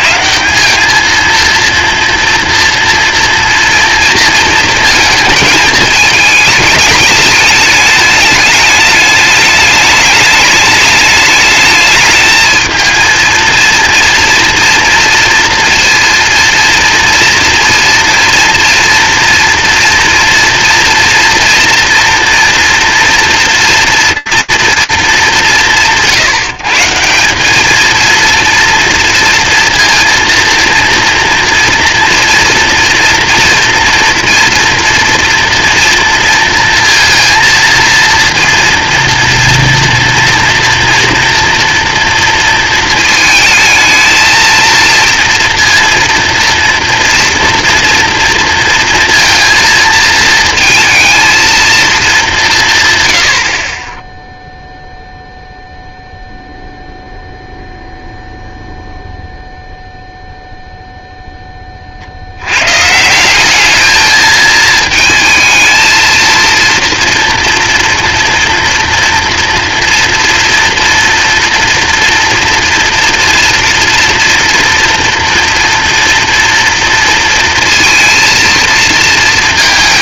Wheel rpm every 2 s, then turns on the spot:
150, 230, 230, 210, 210, 210, 220, 230, 230, 240, 230, 230, 230, 160, 230, 230, 230, 230, 230, 230, 230, 220, 230, 230, 230, 220, 140, 0, 0, 0, 0, 170, 220, 240, 230, 230, 230, 230, 230, 230.
none